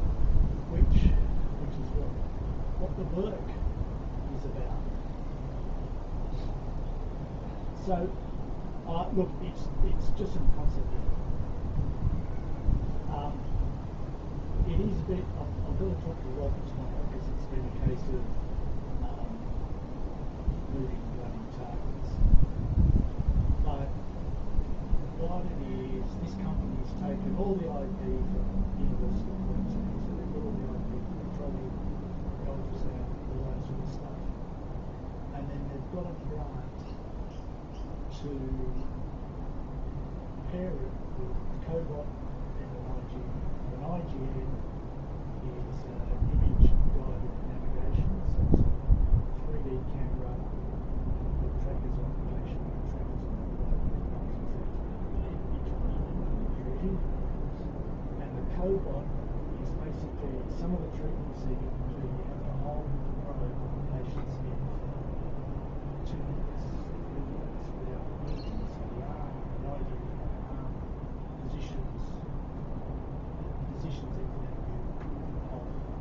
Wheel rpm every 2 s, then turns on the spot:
0, 0, 0, 0, 0, 0, 0, 0, 0, 0, 0, 0, 0, 0, 0, 0, 0, 0, 0, 0, 0, 0, 0, 0, 0, 0, 0, 0, 0, 0, 0, 0, 0, 0, 0, 0, 0, 0.
none